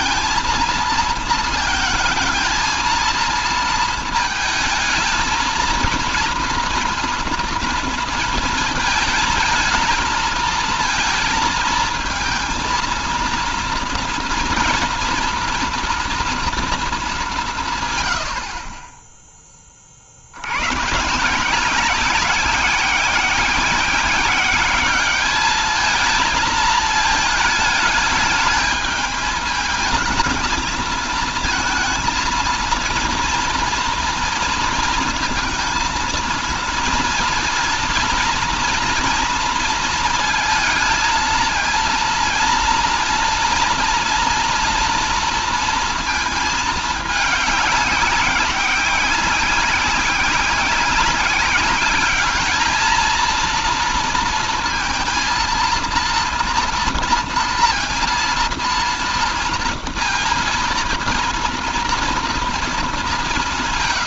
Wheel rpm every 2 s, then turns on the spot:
230, 230, 220, 230, 230, 230, 230, 230, 220, 40, 120, 190, 190, 220, 210, 230, 230, 230, 230, 230, 220, 230, 240, 210, 190, 190, 220, 230, 230, 230, 230, 220.
none